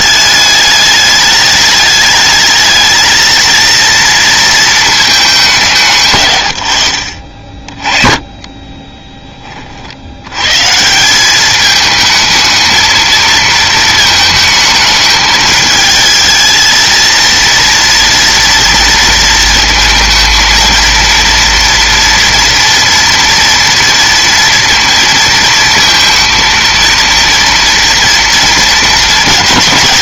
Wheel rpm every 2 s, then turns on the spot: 210, 220, 230, 90, 20, 140, 220, 220, 220, 230, 230, 230, 230, 230, 230.
8-10